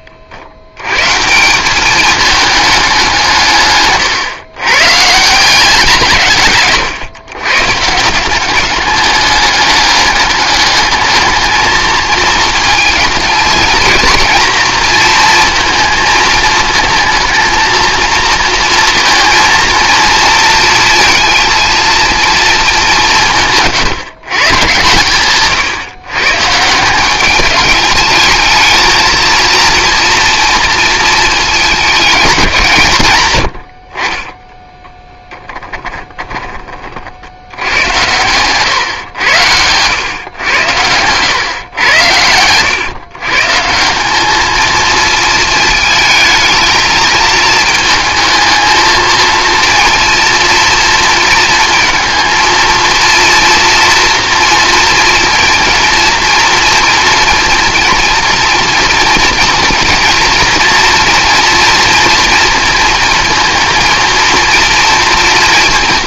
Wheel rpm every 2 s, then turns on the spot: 110, 210, 130, 140, 200, 210, 210, 220, 220, 230, 230, 200, 130, 170, 230, 230, 160, 10, 40, 120, 110, 110, 220, 220, 230, 230, 230, 230, 240, 230, 240, 230, 230.
6-8